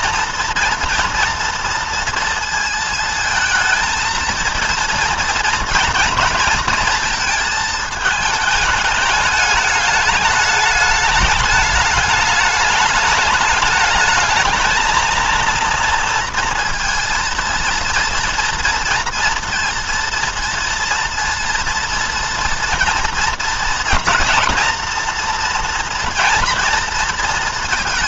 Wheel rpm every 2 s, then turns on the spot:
230, 230, 230, 230, 220, 210, 210, 220, 230, 230, 230, 230, 240, 230.
none